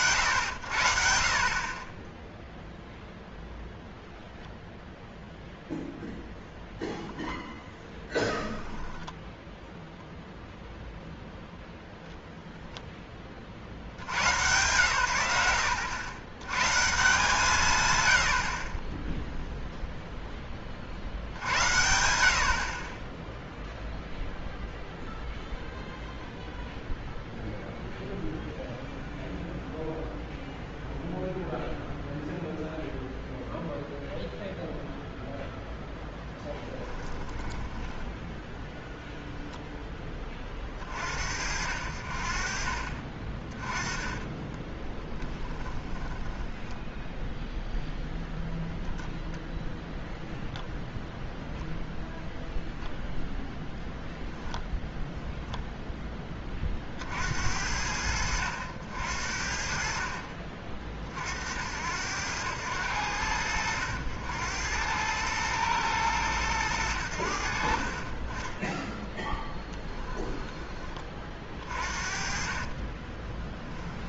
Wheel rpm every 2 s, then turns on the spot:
70, 0, 0, 0, 0, 0, 0, 120, 140, 30, 40, 40, 0, 0, 0, 0, 0, 0, 0, 0, 50, 40, 10, 10, 0, 0, 0, 10, 50, 70, 40, 90, 90, 90, 10, 20, 40.
44-46 68-70 72-74